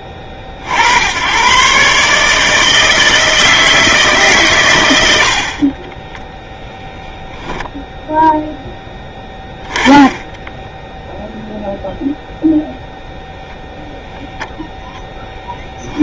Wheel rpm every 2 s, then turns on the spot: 70, 160, 100, 0, 0, 0, 0, 0.
none